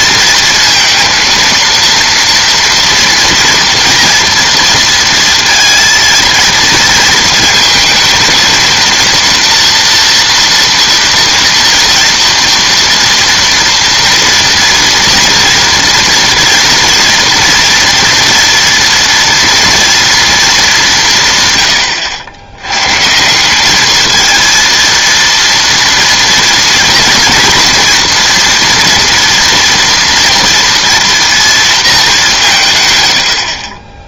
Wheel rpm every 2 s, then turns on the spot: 230, 230, 230, 230, 230, 230, 230, 230, 230, 230, 210, 100, 230, 230, 230, 230, 170.
none